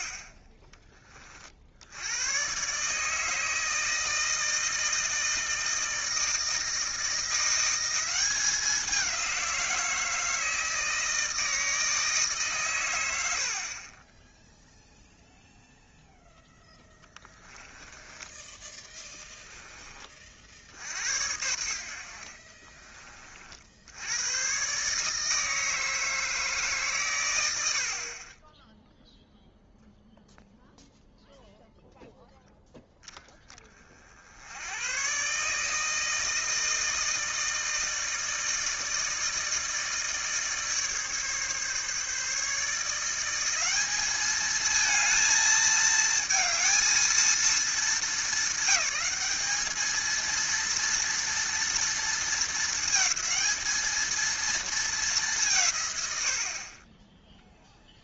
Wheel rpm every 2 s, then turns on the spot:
30, 140, 160, 160, 190, 160, 110, 0, 10, 20, 60, 30, 140, 140, 10, 0, 10, 110, 160, 160, 150, 160, 220, 220, 200, 230, 220, 210, 20.
16-18